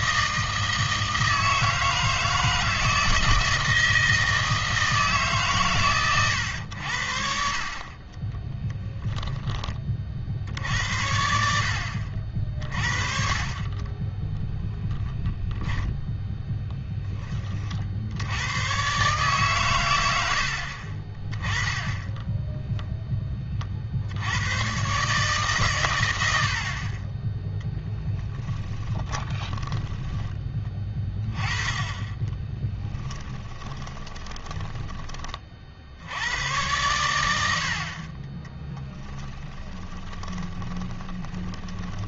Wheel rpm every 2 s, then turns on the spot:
160, 160, 160, 100, 20, 70, 50, 10, 10, 110, 60, 0, 100, 50, 10, 20, 20, 10, 100, 10, 20.
8-10 14-16 28-30 32-36 38-42